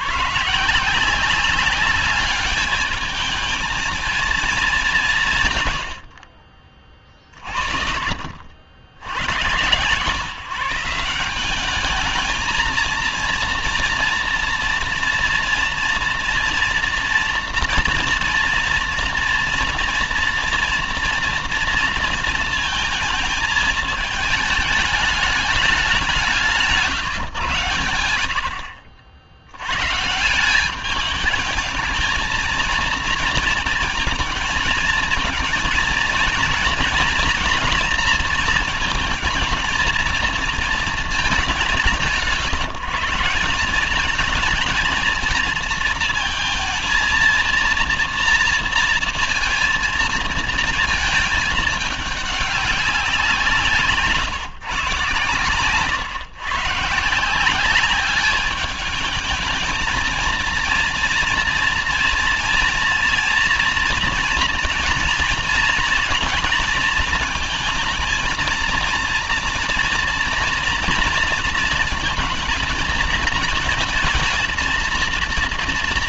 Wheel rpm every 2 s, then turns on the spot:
150, 210, 210, 50, 60, 150, 220, 230, 230, 230, 230, 220, 210, 160, 50, 180, 220, 220, 230, 230, 220, 170, 210, 230, 230, 220, 200, 150, 140, 210, 230, 230, 240, 230, 230, 230, 230, 230.
none